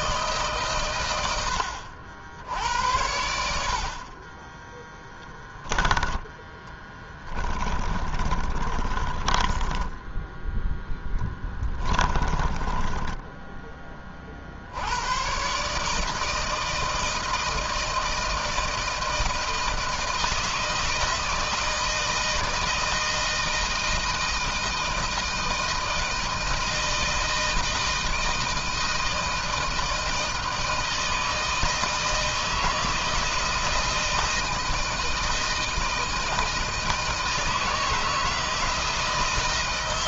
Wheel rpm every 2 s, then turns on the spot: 110, 70, 10, 20, 30, 10, 10, 90, 160, 160, 160, 160, 160, 160, 160, 160, 160, 160, 160, 160.
4-14